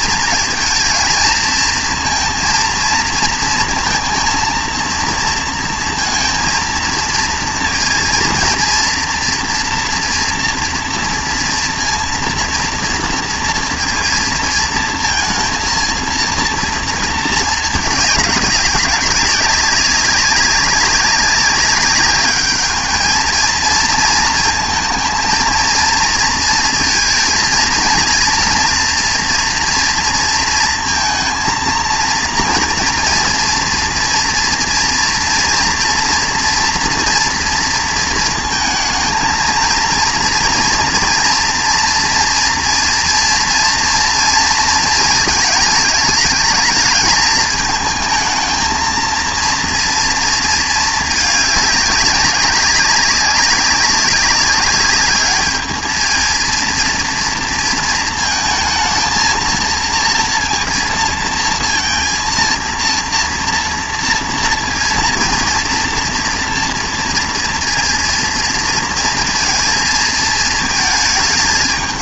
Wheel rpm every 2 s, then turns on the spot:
230, 230, 230, 230, 230, 230, 230, 230, 230, 200, 200, 210, 230, 230, 230, 230, 230, 230, 230, 220, 230, 230, 230, 220, 230, 220, 200, 200, 230, 230, 230, 230, 230, 240, 230, 220.
none